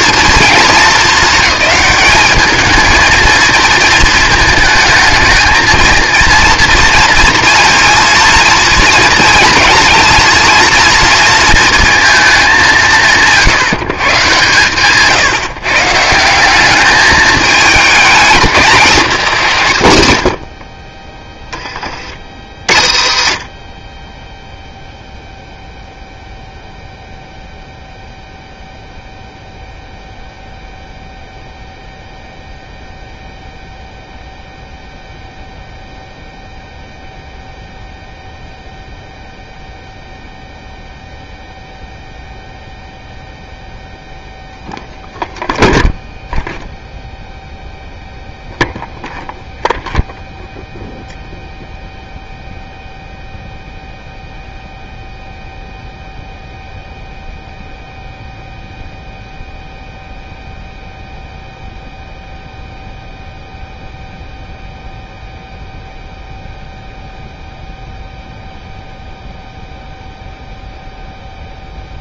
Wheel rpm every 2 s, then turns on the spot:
230, 220, 220, 230, 230, 230, 200, 140, 200, 200, 40, 60, 0, 0, 0, 0, 0, 0, 0, 0, 0, 0, 0, 0, 0, 0, 0, 0, 0, 0, 0, 0, 0, 0, 0, 0.
none